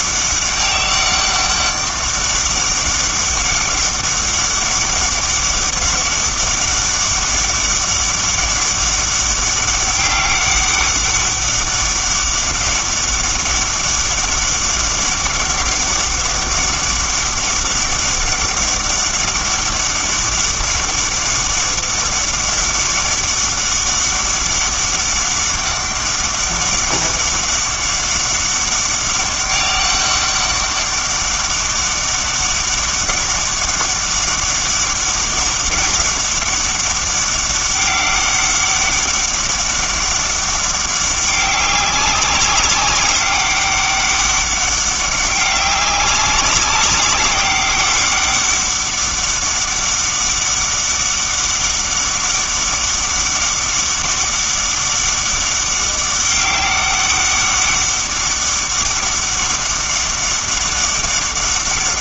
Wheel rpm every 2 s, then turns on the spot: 200, 200, 200, 200, 200, 200, 200, 200, 200, 200, 200, 200, 200, 200, 190, 200, 200, 200, 200, 200, 200, 200, 200, 190, 200, 200, 200, 200, 200, 200, 200.
none